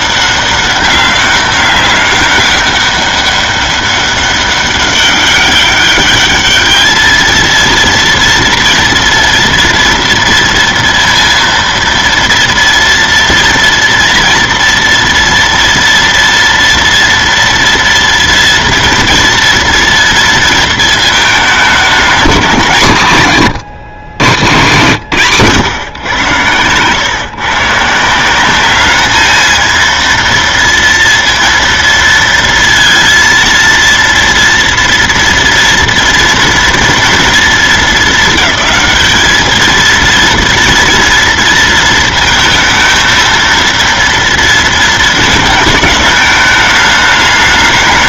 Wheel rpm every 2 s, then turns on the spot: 200, 200, 200, 210, 230, 230, 230, 230, 230, 230, 230, 180, 140, 120, 200, 230, 230, 230, 240, 200, 230, 230, 230, 210.
none